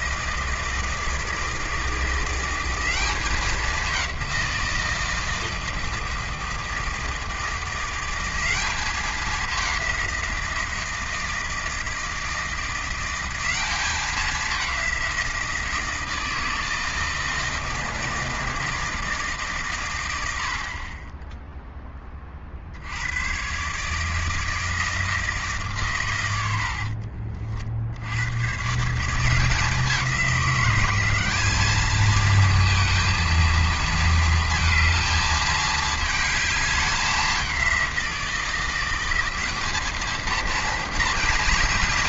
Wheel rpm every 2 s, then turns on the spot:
160, 180, 170, 160, 200, 170, 170, 200, 160, 160, 70, 60, 160, 80, 140, 180, 220, 230, 210, 170, 230.
26-28